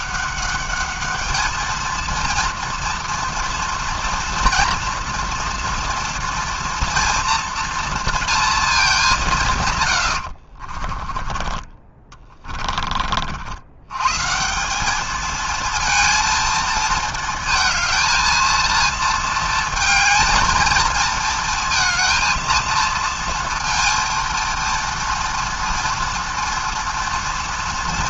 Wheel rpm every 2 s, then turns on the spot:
200, 230, 230, 240, 220, 50, 30, 180, 230, 230, 220, 230, 230, 230.
10-14